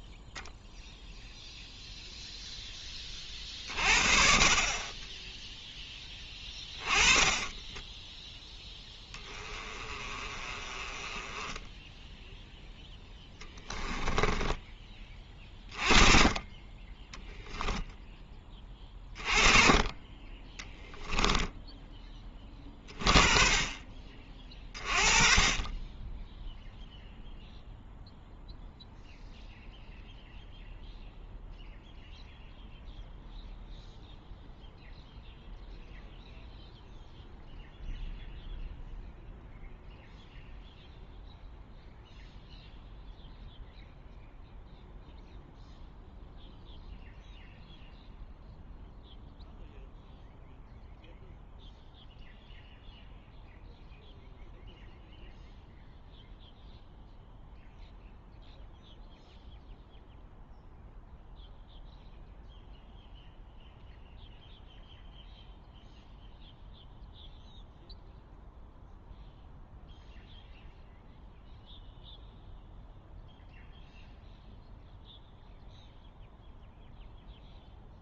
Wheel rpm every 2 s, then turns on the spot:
0, 20, 30, 20, 10, 20, 0, 20, 20, 20, 10, 30, 30, 0, 0, 0, 0, 0, 0, 0, 0, 0, 0, 0, 0, 0, 0, 0, 0, 0, 0, 0, 0, 0, 0, 0, 0, 0, 0.
6-8 20-22